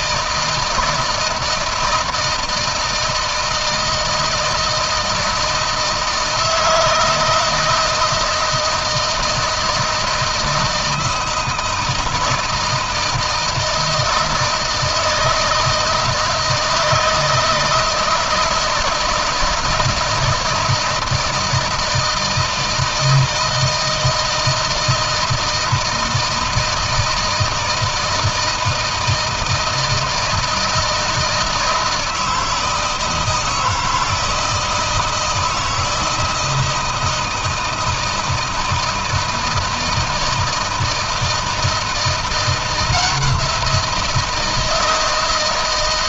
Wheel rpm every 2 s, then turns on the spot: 160, 160, 160, 160, 160, 160, 170, 160, 160, 160, 160, 160, 160, 160, 160, 160, 160, 160, 160, 160, 160, 170, 160.
none